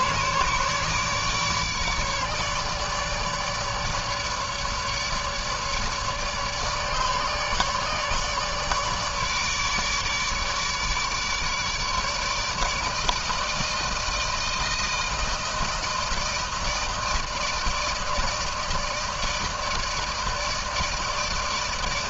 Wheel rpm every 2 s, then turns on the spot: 150, 150, 150, 150, 150, 150, 150, 160, 160, 160, 160.
none